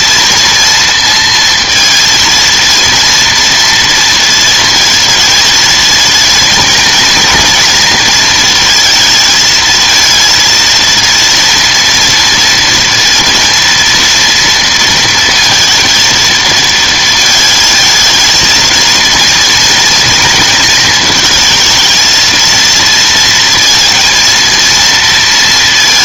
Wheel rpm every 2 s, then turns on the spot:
230, 230, 230, 230, 230, 230, 230, 230, 230, 230, 220, 230, 230.
none